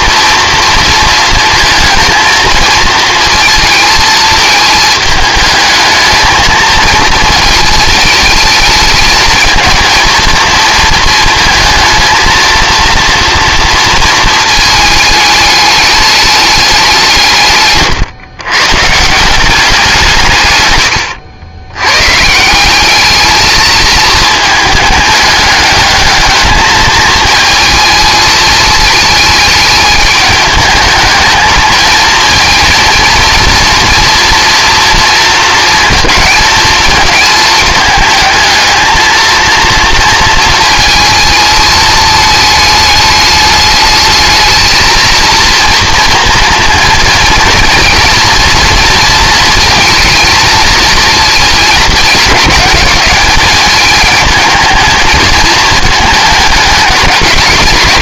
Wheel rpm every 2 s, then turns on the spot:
230, 230, 220, 220, 220, 230, 230, 220, 210, 130, 120, 180, 210, 220, 220, 210, 230, 240, 230, 220, 230, 210, 220, 230, 230, 220, 210, 220, 220.
20-22